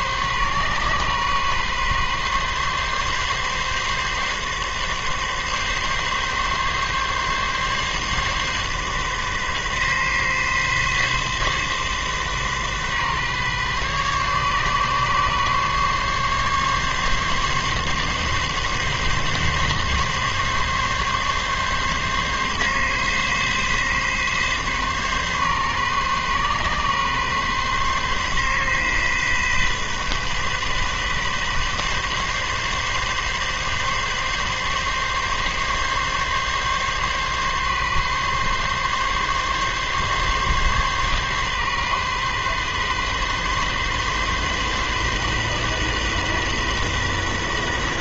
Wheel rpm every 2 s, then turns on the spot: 130, 140, 140, 140, 140, 130, 130, 140, 140, 140, 140, 140, 130, 130, 130, 130, 140, 140, 140, 140, 140, 130, 130, 130.
none